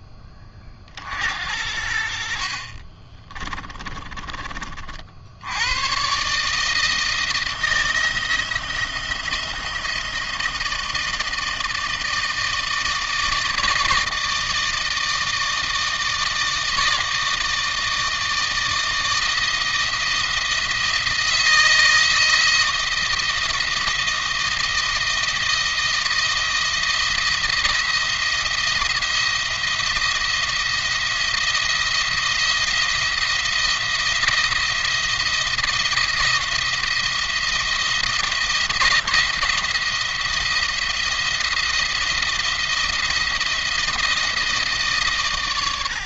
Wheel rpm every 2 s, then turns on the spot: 40, 50, 40, 150, 170, 160, 160, 160, 160, 160, 160, 170, 170, 170, 170, 170, 170, 170, 170, 170, 170, 170, 160.
2-4